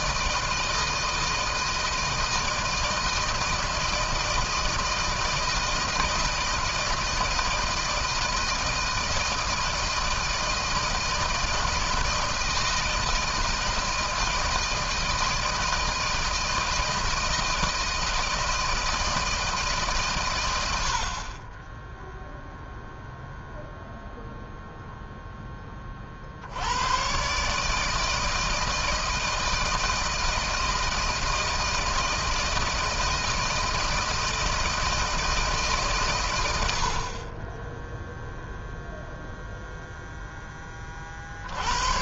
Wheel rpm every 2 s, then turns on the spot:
160, 160, 160, 160, 160, 160, 160, 160, 160, 160, 90, 0, 0, 70, 160, 160, 160, 160, 90, 0, 20.
none